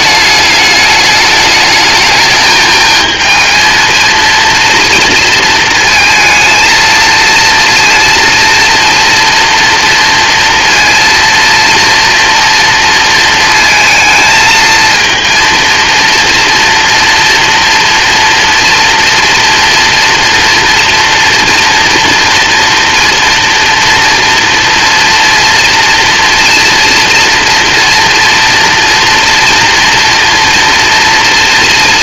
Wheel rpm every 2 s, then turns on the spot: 210, 220, 230, 230, 230, 230, 230, 230, 230, 230, 230, 230, 230, 230, 240, 220.
none